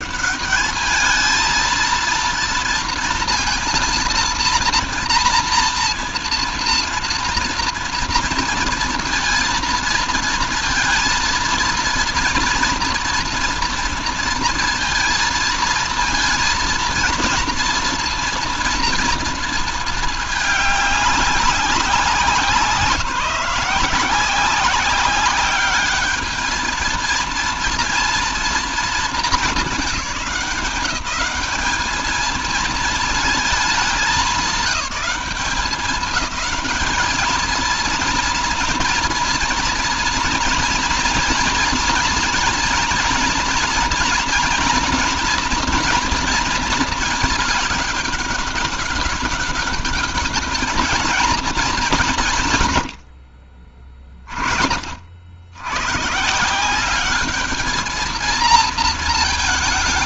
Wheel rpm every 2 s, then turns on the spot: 210, 230, 230, 230, 230, 230, 230, 230, 230, 230, 210, 180, 190, 220, 230, 200, 220, 190, 210, 230, 230, 230, 230, 230, 200, 220, 140, 40, 170, 230.
none